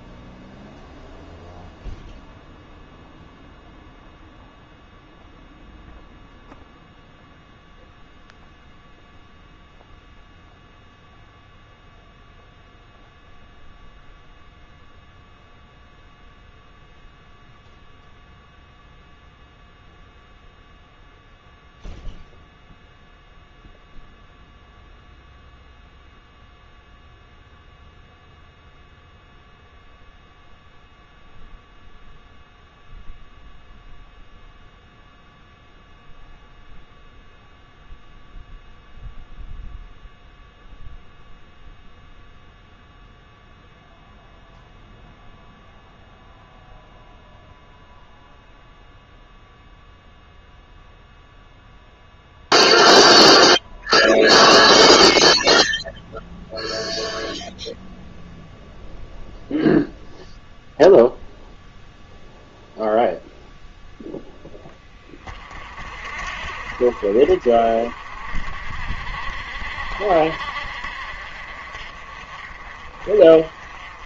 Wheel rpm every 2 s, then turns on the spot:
0, 0, 0, 0, 0, 0, 0, 0, 0, 0, 0, 0, 0, 0, 0, 0, 0, 0, 0, 0, 0, 0, 0, 0, 0, 0, 0, 0, 0, 0, 0, 0, 20, 50, 50, 50, 40.
none